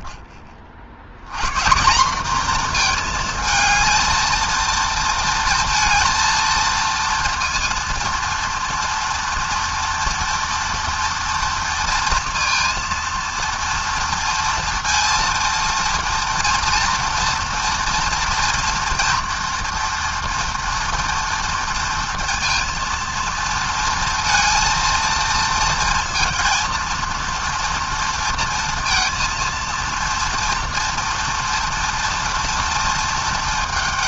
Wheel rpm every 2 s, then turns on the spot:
130, 230, 230, 230, 230, 230, 230, 230, 230, 230, 230, 230, 230, 230, 230, 230, 220.
none